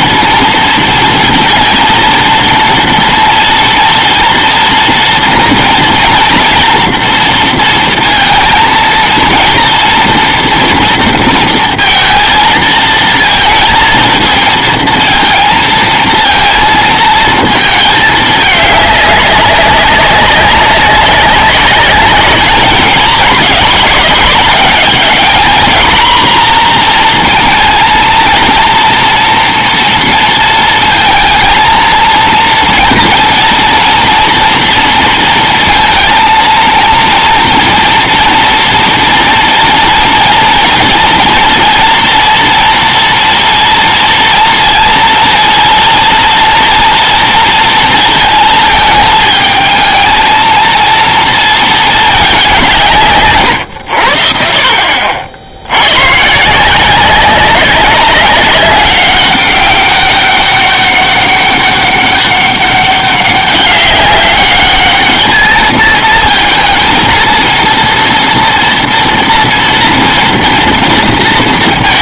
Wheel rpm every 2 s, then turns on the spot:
230, 230, 230, 240, 230, 230, 230, 220, 230, 210, 190, 210, 220, 240, 230, 230, 230, 230, 230, 230, 230, 230, 230, 230, 220, 220, 190, 60, 160, 200, 200, 200, 200, 230, 230, 230.
none